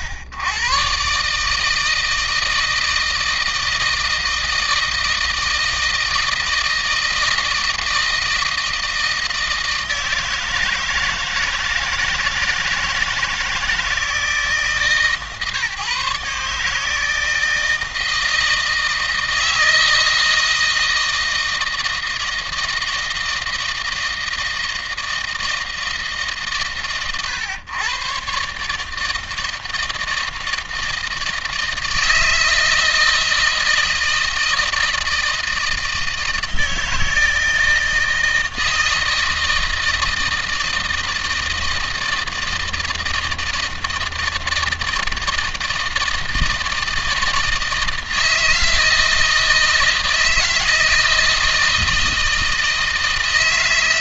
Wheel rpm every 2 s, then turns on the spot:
110, 160, 160, 160, 160, 160, 160, 150, 150, 160, 160, 160, 160, 130, 130, 160, 160, 160, 160, 160, 160, 160, 160, 160, 160, 160, 160.
none